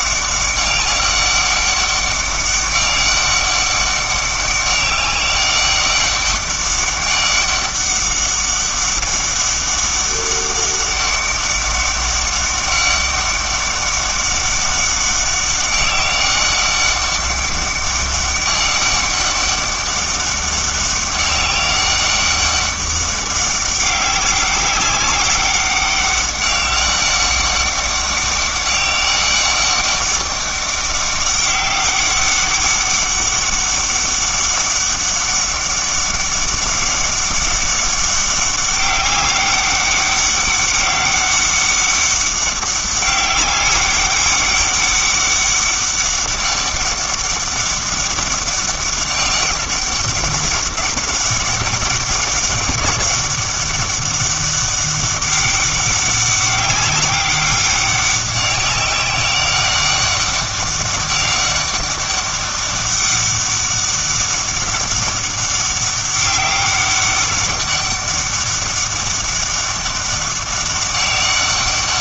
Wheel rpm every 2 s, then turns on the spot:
200, 200, 200, 200, 200, 200, 200, 200, 200, 190, 200, 200, 190, 200, 200, 200, 200, 200, 200, 200, 200, 200, 200, 190, 200, 200, 200, 200, 200, 190, 200, 200, 200, 190, 200, 200.
none